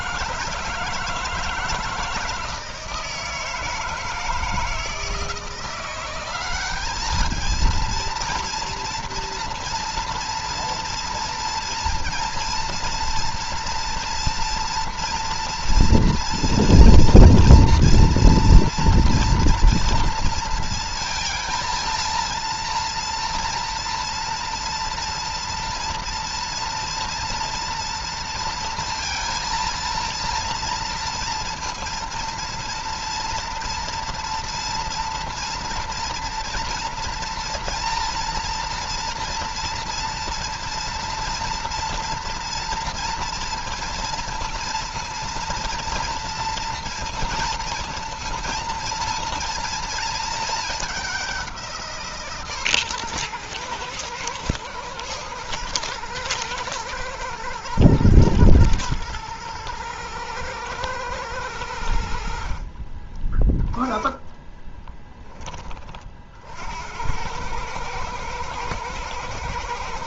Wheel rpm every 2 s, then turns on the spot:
160, 160, 170, 200, 230, 230, 230, 240, 230, 230, 230, 230, 230, 230, 230, 230, 230, 230, 230, 230, 230, 230, 230, 230, 230, 210, 130, 120, 120, 110, 110, 40, 10, 70, 110.
none